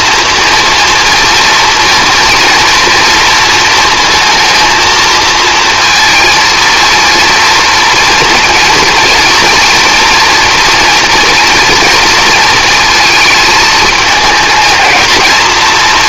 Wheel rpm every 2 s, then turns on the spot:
230, 230, 230, 230, 230, 230, 230, 220.
none